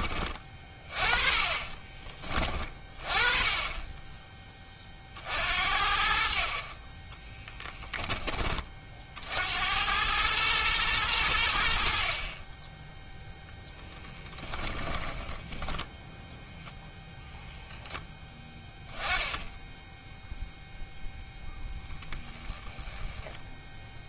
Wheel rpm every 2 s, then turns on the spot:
30, 30, 20, 40, 40, 110, 20, 10, 0, 10, 0, 10.
14-16